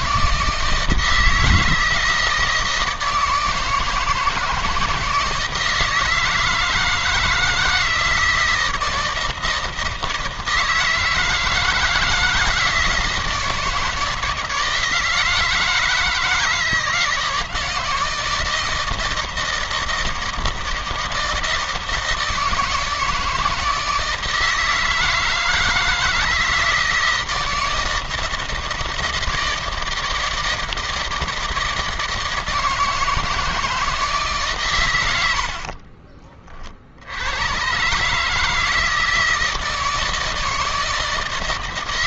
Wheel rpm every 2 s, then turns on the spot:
160, 160, 160, 160, 170, 160, 160, 160, 160, 160, 160, 160, 160, 160, 160, 160, 160, 140, 50, 150, 160.
none